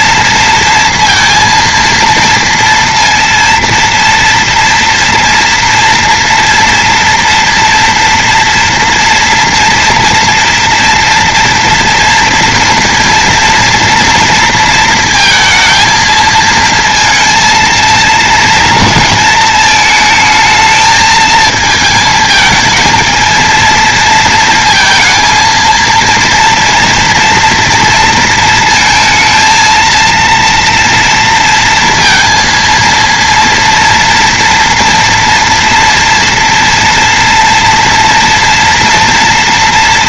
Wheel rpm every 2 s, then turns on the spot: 230, 230, 240, 230, 230, 230, 230, 230, 230, 230, 220, 220, 230, 230, 230, 230, 230, 230, 230, 230.
none